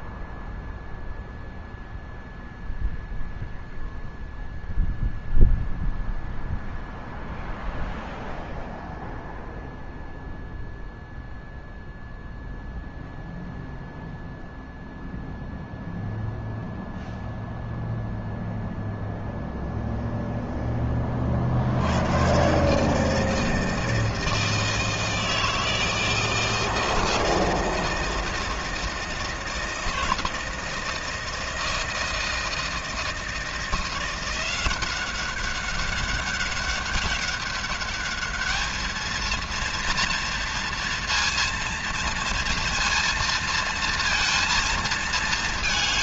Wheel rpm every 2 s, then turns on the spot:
0, 0, 0, 0, 0, 0, 0, 0, 0, 0, 10, 140, 160, 160, 160, 160, 160, 180, 200, 220, 230, 230, 230.
none